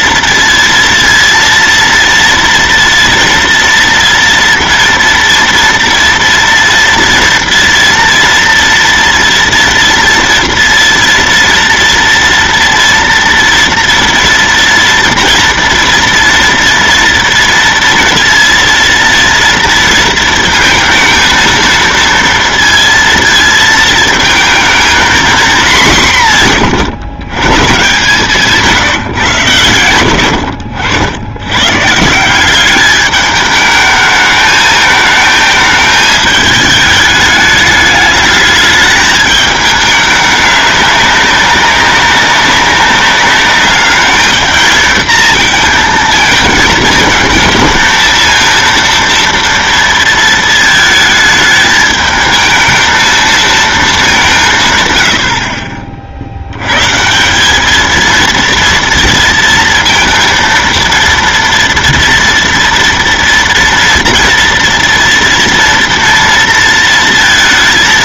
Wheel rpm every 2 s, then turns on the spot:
230, 230, 230, 230, 230, 230, 230, 230, 230, 230, 230, 230, 220, 150, 160, 80, 190, 220, 210, 210, 200, 200, 220, 220, 230, 220, 220, 160, 90, 230, 230, 230, 230, 230.
none